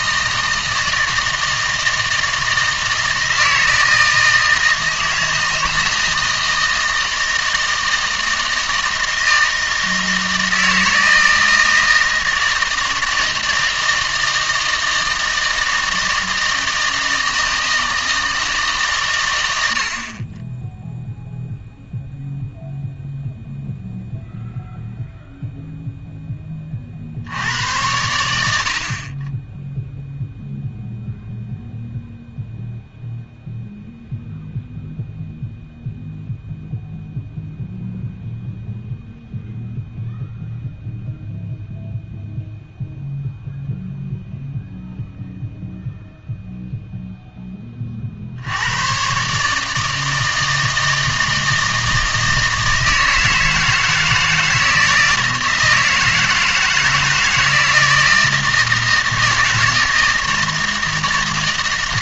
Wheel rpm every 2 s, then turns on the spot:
160, 160, 160, 160, 160, 160, 160, 160, 160, 150, 10, 0, 0, 30, 70, 0, 0, 0, 0, 0, 0, 0, 0, 0, 90, 160, 160, 160, 160, 160, 160.
none